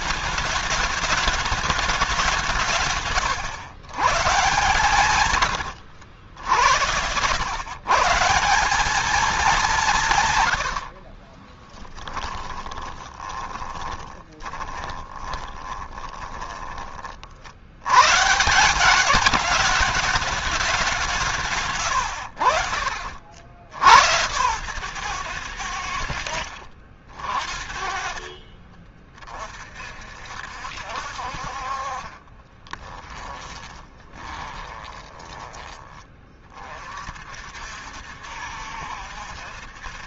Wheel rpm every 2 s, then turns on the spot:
210, 150, 150, 90, 200, 70, 20, 20, 30, 180, 200, 80, 120, 60, 30, 60, 20, 20, 40, 70.
2-4 10-16 22-24 32-36